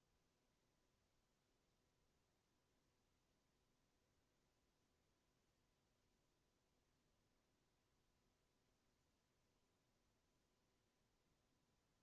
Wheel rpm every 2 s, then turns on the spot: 0, 0, 0, 0, 0, 0.
none